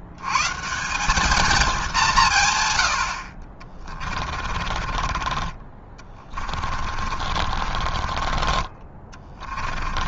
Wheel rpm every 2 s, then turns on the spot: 90, 200, 30, 20, 40.
4-10